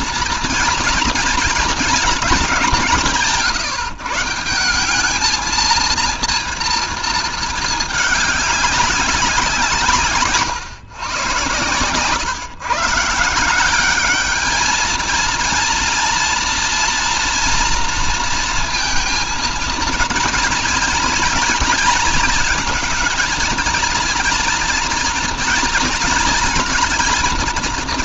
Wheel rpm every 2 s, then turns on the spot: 230, 160, 200, 220, 200, 120, 160, 230, 240, 230, 230, 230, 240, 230.
none